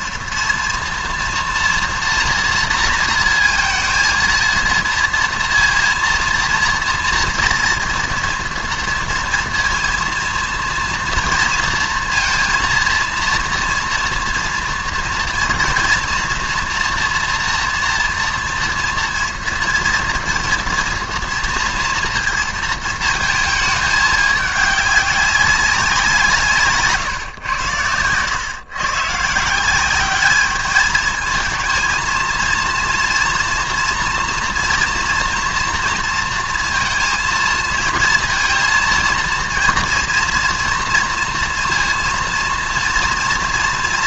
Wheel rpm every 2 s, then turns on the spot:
240, 230, 230, 230, 230, 230, 230, 230, 230, 230, 230, 230, 200, 140, 130, 210, 230, 230, 230, 230, 230, 230.
none